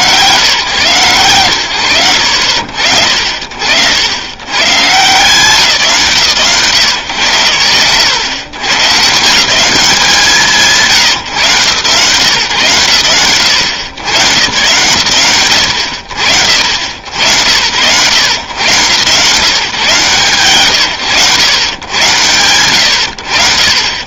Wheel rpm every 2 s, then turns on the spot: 130, 50, 130, 120, 150, 140, 110, 130, 60, 130, 100, 90.
none